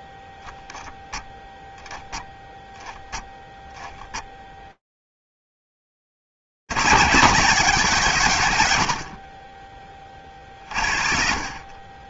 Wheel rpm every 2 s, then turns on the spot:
0, 0, 0, 20, 150, 30.
none